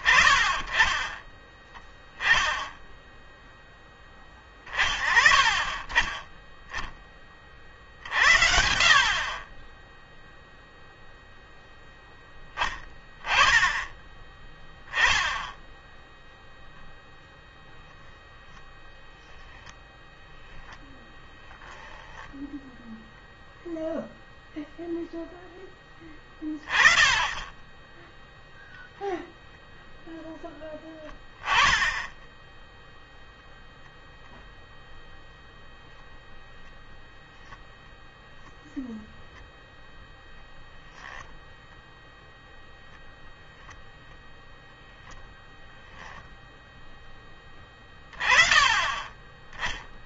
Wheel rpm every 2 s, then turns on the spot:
30, 10, 40, 20, 70, 0, 10, 10, 0, 0, 0, 10, 0, 10, 0, 10, 10, 0, 0, 10, 0, 0, 0, 0, 30.
none